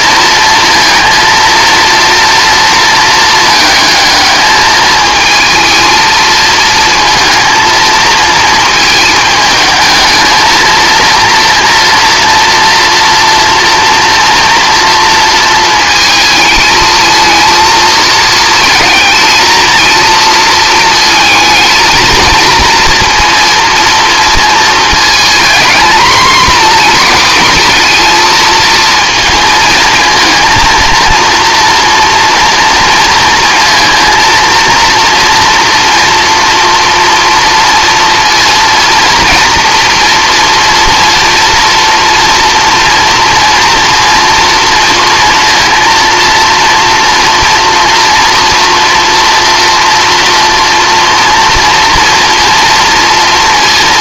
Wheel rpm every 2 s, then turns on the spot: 230, 220, 220, 230, 220, 230, 230, 230, 220, 220, 220, 230, 220, 230, 230, 230, 230, 230, 230, 230, 230, 230, 230, 230, 230, 230, 230.
none